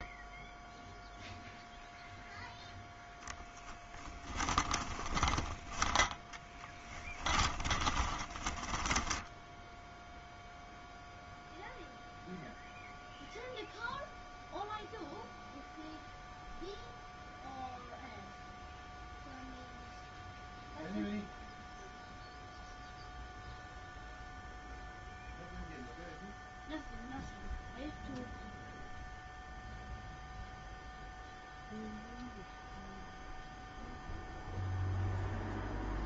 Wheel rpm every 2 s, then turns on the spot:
0, 0, 20, 10, 10, 0, 0, 0, 0, 0, 0, 0, 0, 0, 0, 0, 0, 0.
4-10